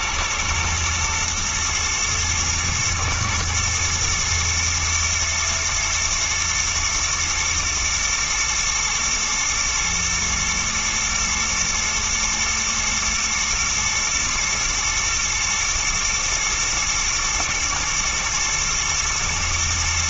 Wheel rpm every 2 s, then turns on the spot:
120, 120, 110, 120, 110, 110, 110, 110, 110, 110.
none